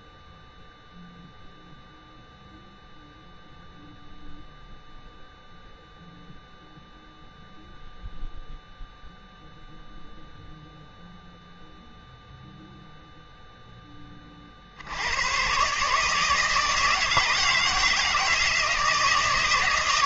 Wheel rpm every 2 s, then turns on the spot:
0, 0, 0, 0, 0, 0, 0, 60, 160, 160.
none